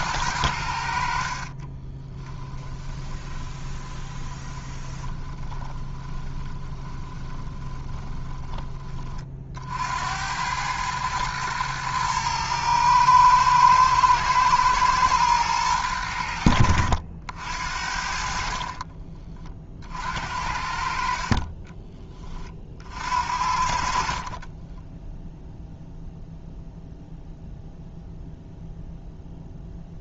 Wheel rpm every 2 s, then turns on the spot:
80, 10, 20, 20, 30, 110, 110, 120, 70, 40, 60, 50, 10, 0, 0.
2-8 18-20 24-26